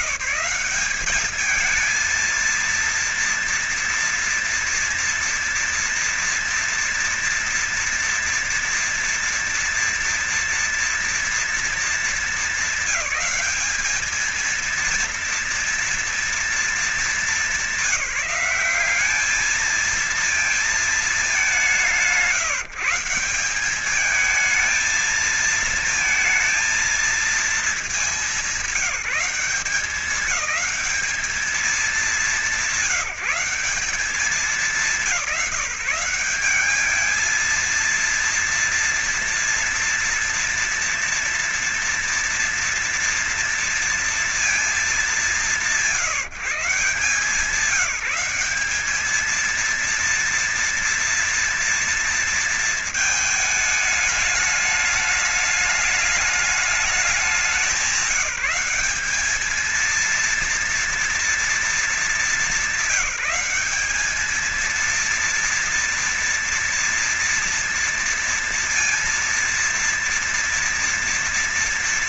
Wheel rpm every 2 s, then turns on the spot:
210, 230, 230, 230, 230, 230, 200, 230, 220, 190, 220, 170, 220, 230, 190, 200, 190, 190, 200, 230, 230, 230, 220, 160, 210, 230, 220, 210, 210, 190, 230, 200, 230, 230, 230, 230.
none